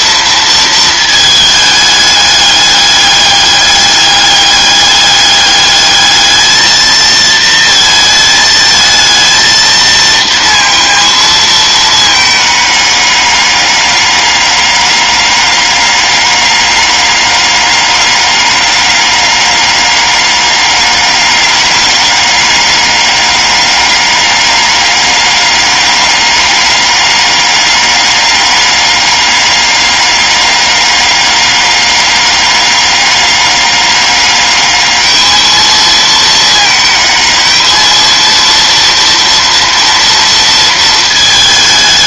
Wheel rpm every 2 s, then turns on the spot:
230, 210, 210, 220, 220, 230, 210, 200, 200, 200, 200, 200, 200, 200, 200, 200, 200, 210, 220, 230, 230.
none